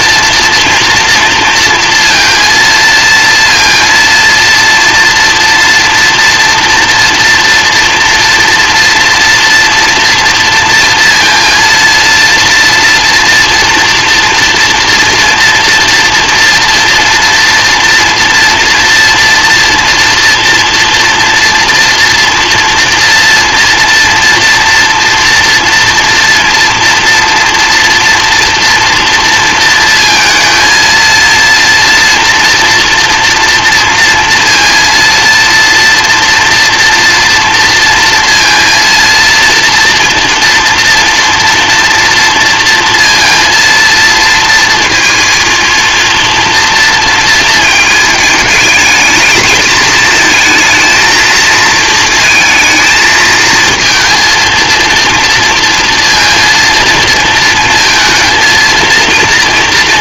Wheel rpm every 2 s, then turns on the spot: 230, 230, 230, 230, 230, 230, 240, 230, 230, 230, 230, 230, 230, 230, 230, 230, 230, 230, 240, 230, 240, 230, 230, 230, 220, 230, 220, 230, 230, 230.
none